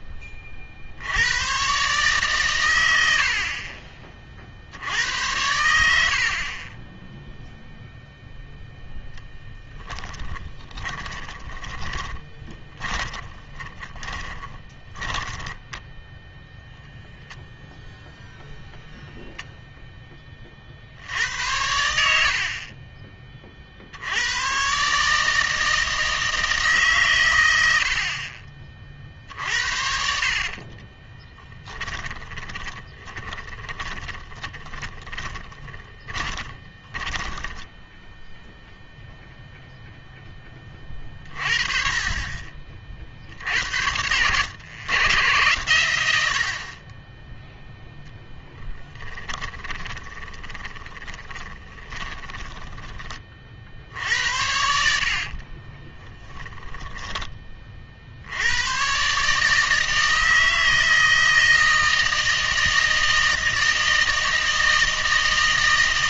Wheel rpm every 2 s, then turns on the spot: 50, 110, 60, 30, 0, 20, 20, 20, 0, 0, 50, 40, 120, 150, 40, 40, 20, 20, 20, 0, 30, 40, 120, 40, 10, 10, 30, 70, 10, 100, 160, 160, 160.
6-8 10-16 30-38 48-54 56-58